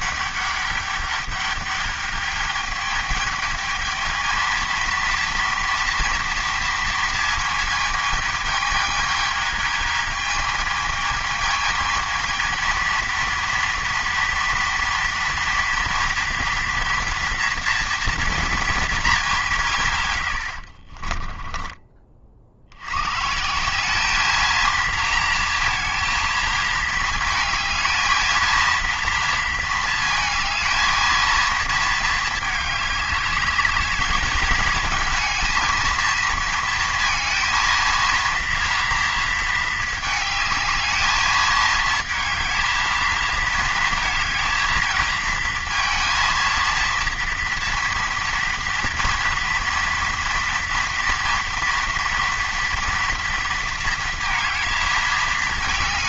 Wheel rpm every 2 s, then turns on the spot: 200, 210, 230, 230, 220, 220, 230, 230, 230, 230, 80, 70, 220, 220, 230, 220, 210, 220, 230, 230, 220, 220, 230, 230, 230, 230, 230, 220.
20-22